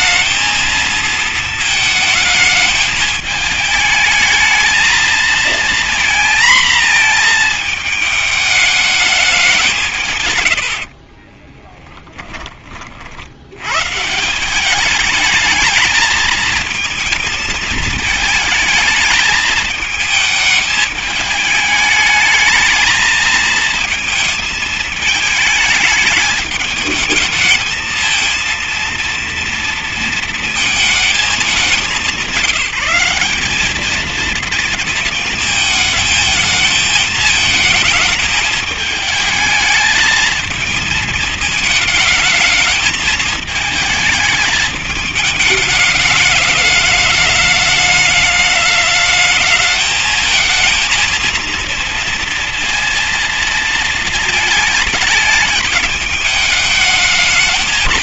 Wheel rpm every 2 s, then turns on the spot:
230, 220, 230, 230, 210, 40, 50, 210, 230, 220, 220, 220, 220, 210, 230, 210, 190, 220, 220, 210, 220, 220, 210, 210, 210, 220, 230, 220, 210.
10-12